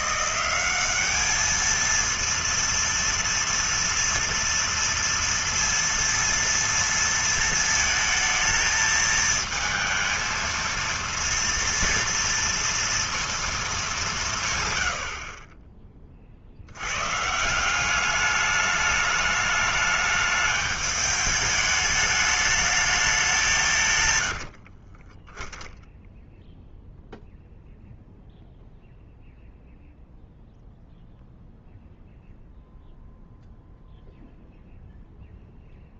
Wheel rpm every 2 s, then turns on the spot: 190, 230, 230, 230, 220, 230, 230, 140, 70, 210, 210, 210, 70, 0, 0, 0, 0, 0.
24-26